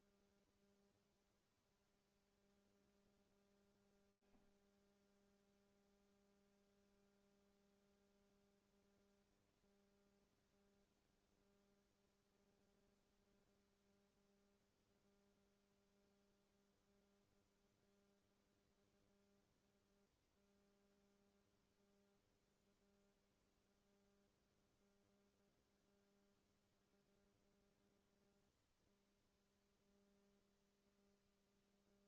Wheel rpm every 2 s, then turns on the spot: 0, 0, 0, 0, 0, 0, 0, 0, 0, 0, 0, 0, 0, 0, 0, 0.
none